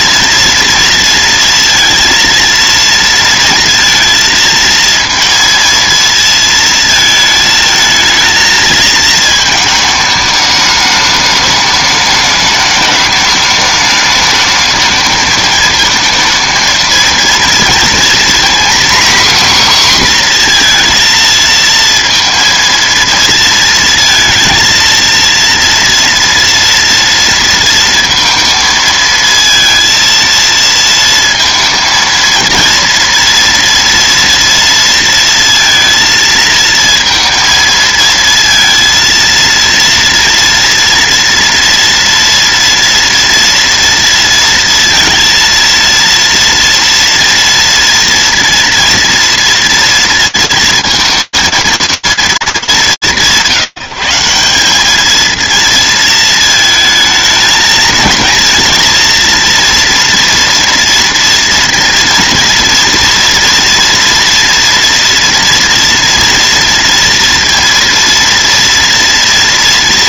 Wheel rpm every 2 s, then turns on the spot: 230, 230, 230, 230, 220, 210, 210, 220, 230, 260, 240, 230, 230, 230, 230, 230, 230, 230, 230, 230, 240, 230, 230, 230, 230, 230, 180, 210, 220, 230, 230, 230, 230, 230, 230.
none